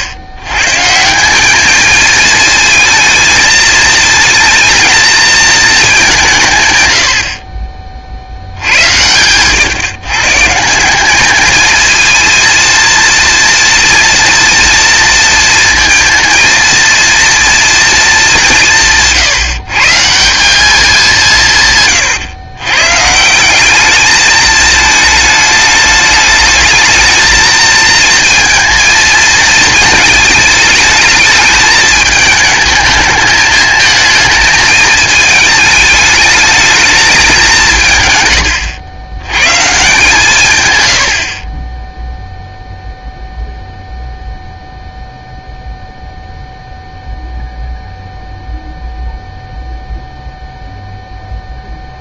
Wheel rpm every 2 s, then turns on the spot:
110, 220, 230, 140, 80, 160, 230, 230, 230, 180, 200, 120, 220, 220, 230, 210, 220, 220, 210, 100, 130, 0, 0, 0, 0, 0.
none